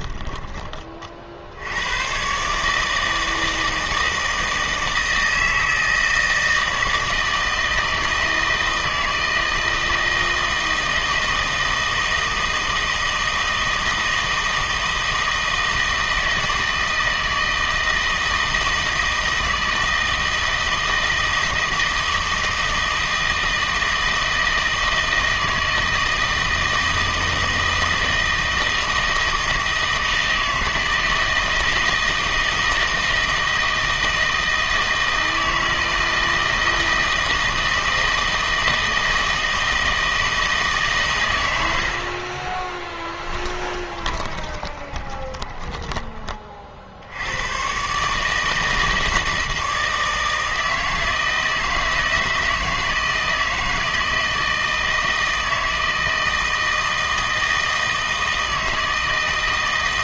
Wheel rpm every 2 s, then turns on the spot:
20, 150, 160, 160, 160, 160, 160, 160, 160, 160, 160, 160, 160, 160, 160, 160, 160, 160, 160, 160, 150, 20, 20, 40, 160, 160, 160, 160, 160, 160.
42-46